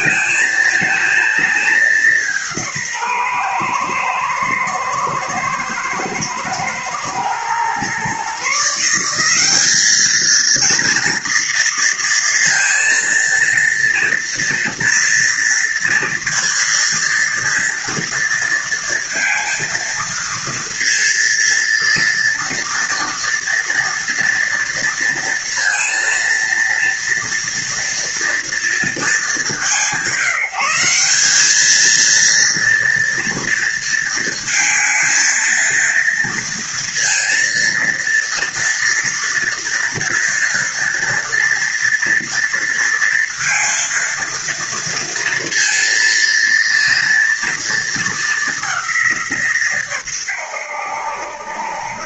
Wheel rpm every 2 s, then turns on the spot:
220, 160, 110, 120, 170, 230, 230, 230, 230, 230, 230, 230, 230, 230, 220, 190, 230, 230, 230, 230, 230, 230, 230, 230, 190, 80.
none